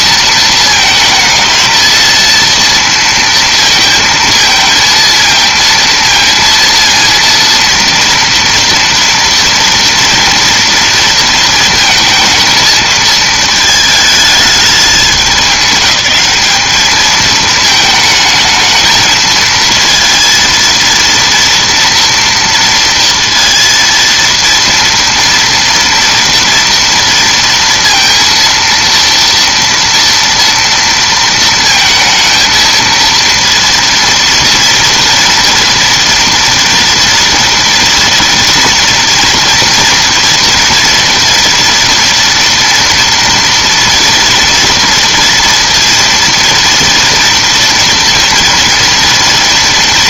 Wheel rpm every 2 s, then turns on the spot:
220, 230, 230, 230, 230, 230, 220, 210, 200, 220, 230, 230, 230, 230, 230, 230, 230, 230, 230, 230, 230, 230, 230, 230, 230.
none